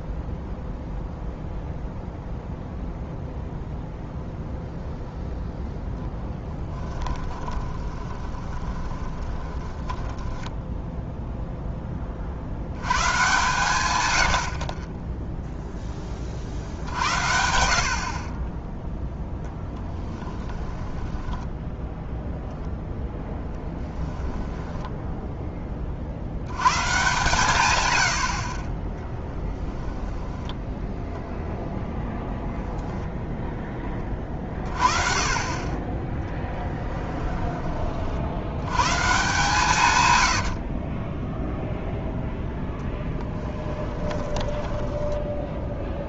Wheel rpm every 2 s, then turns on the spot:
0, 0, 0, 10, 20, 0, 90, 40, 60, 10, 10, 0, 10, 120, 30, 10, 0, 30, 20, 100, 50, 20, 20.
6-10 20-22 24-26 36-38 40-42 44-46